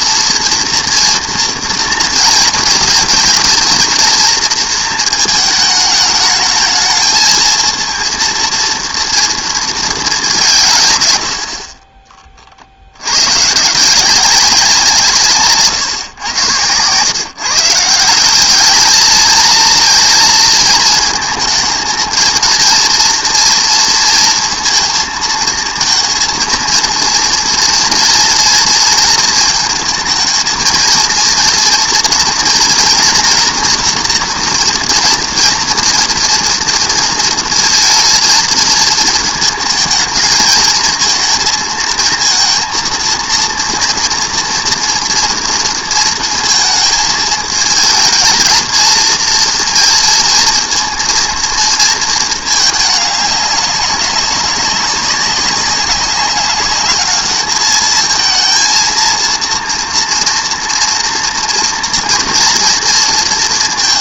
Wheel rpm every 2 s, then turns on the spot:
230, 220, 230, 220, 230, 160, 60, 170, 120, 210, 220, 230, 230, 230, 230, 230, 240, 240, 240, 220, 230, 230, 230, 220, 220, 230, 210, 200, 210, 230, 230, 230.
none